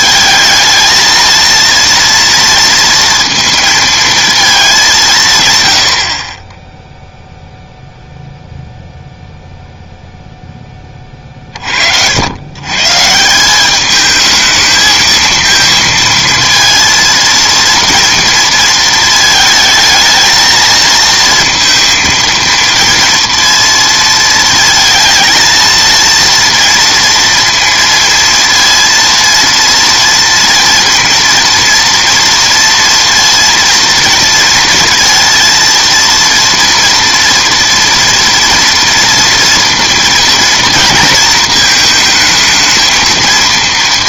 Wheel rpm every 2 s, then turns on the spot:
220, 230, 210, 20, 0, 10, 130, 220, 230, 230, 220, 230, 230, 230, 230, 230, 230, 230, 230, 230, 230, 220.
none